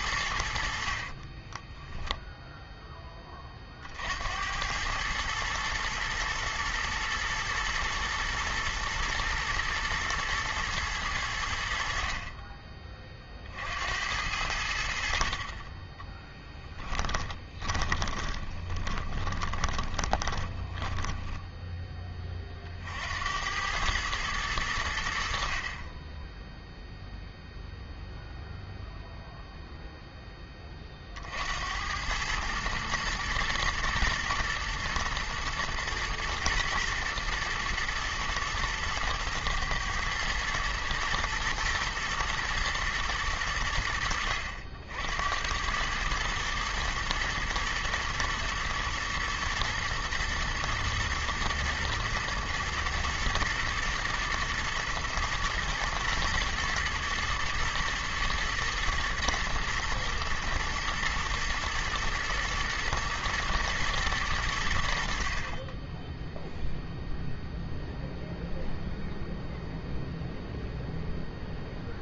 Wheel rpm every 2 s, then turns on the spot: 60, 0, 90, 110, 110, 110, 30, 80, 30, 40, 20, 50, 90, 0, 0, 30, 110, 120, 110, 110, 110, 110, 70, 110, 120, 120, 120, 110, 110, 120, 120, 110, 80, 0, 0, 0.
16-22